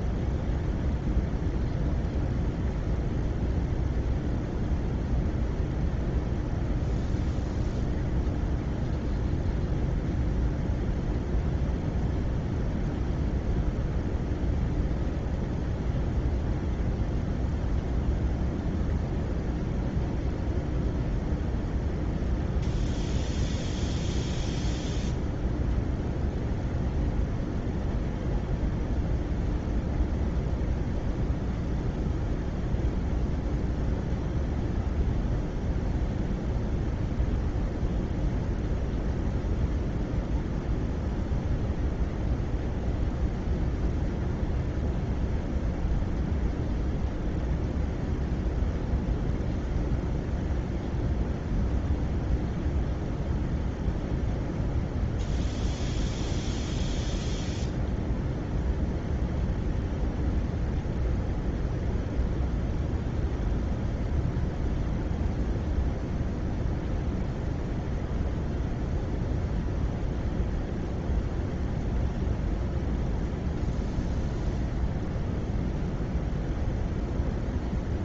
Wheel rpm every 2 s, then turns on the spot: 0, 0, 0, 0, 0, 0, 0, 0, 0, 0, 0, 0, 0, 0, 0, 0, 0, 0, 0, 0, 0, 0, 0, 0, 0, 0, 0, 0, 0, 0, 0, 0, 0, 0, 0, 0, 0, 0, 0.
none